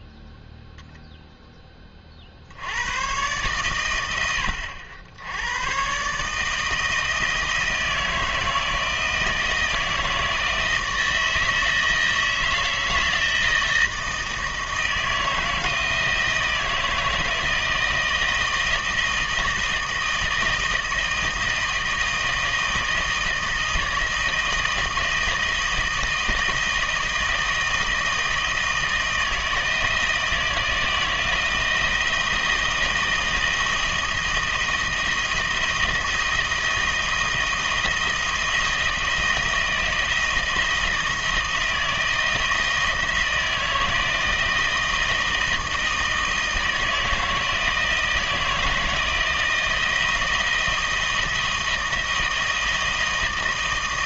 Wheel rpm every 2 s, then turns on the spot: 0, 90, 90, 160, 160, 160, 160, 160, 160, 160, 160, 160, 160, 160, 160, 170, 170, 170, 170, 170, 170, 160, 170, 160, 160, 160, 160.
none